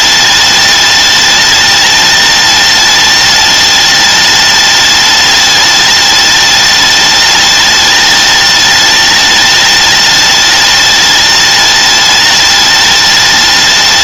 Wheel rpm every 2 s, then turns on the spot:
210, 210, 210, 210, 210, 210, 210.
none